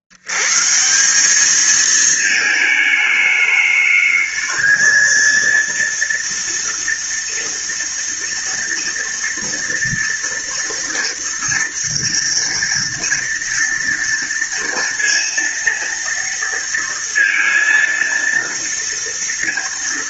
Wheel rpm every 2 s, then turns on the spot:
80, 220, 220, 230, 230, 230, 230, 230, 230, 230.
none